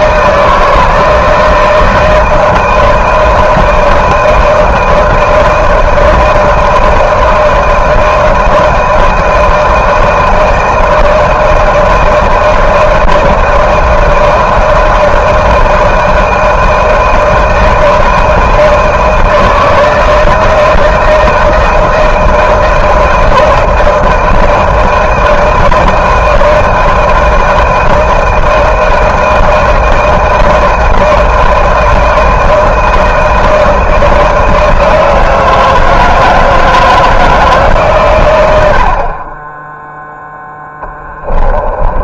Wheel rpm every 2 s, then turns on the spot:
160, 160, 160, 160, 160, 160, 160, 160, 160, 160, 160, 160, 160, 160, 160, 160, 160, 160, 160, 90, 10.
40-42